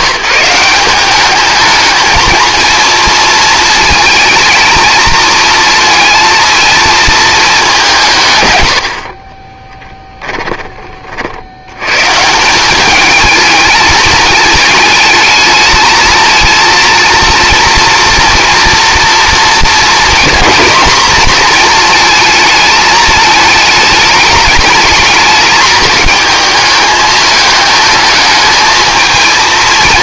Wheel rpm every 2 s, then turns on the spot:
170, 230, 220, 230, 110, 20, 190, 220, 230, 230, 230, 220, 210, 210, 220.
none